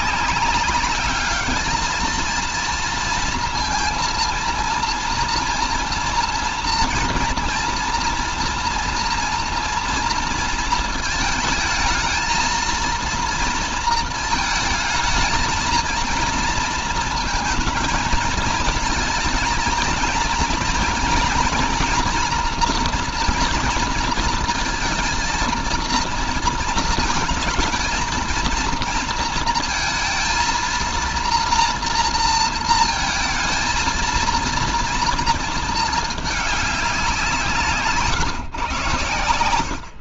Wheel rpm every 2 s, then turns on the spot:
200, 230, 230, 230, 230, 230, 230, 220, 230, 220, 240, 240, 230, 230, 230, 230, 220, 230, 200, 110.
none